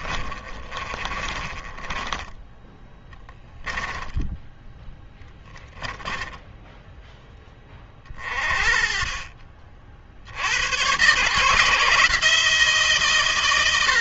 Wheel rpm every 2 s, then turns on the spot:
30, 10, 10, 10, 40, 90, 150.
0-2 4-6